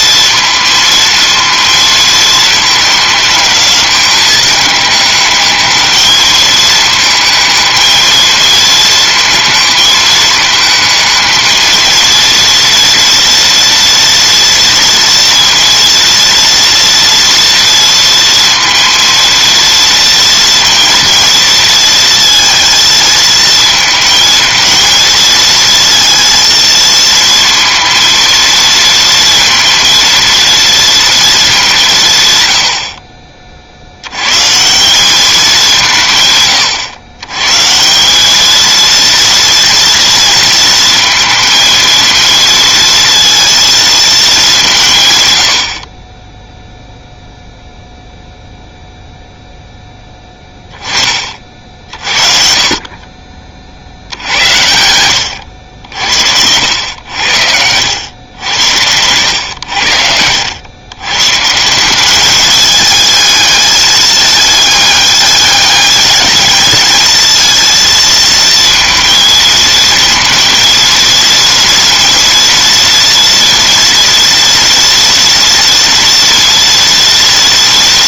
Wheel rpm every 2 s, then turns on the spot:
230, 220, 210, 220, 220, 220, 230, 230, 230, 230, 230, 220, 230, 230, 230, 230, 70, 190, 110, 230, 230, 230, 140, 0, 0, 30, 40, 90, 90, 100, 110, 210, 210, 220, 230, 230, 230, 230, 230.
none